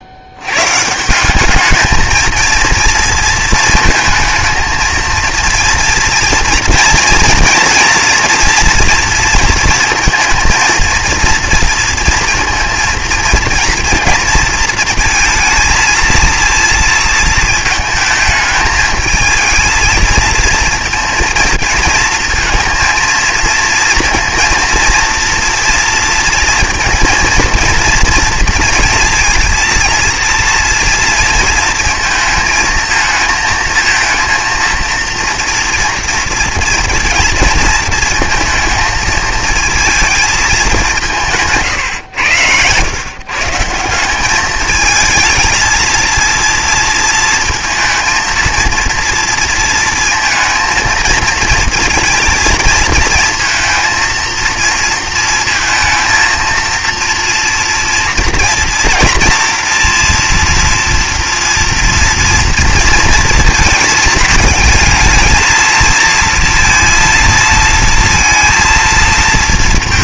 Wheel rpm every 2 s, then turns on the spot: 150, 230, 230, 240, 230, 230, 230, 230, 230, 220, 230, 230, 230, 230, 230, 230, 220, 230, 230, 220, 190, 130, 220, 230, 230, 230, 220, 230, 230, 230, 240, 230, 220, 230, 230.
none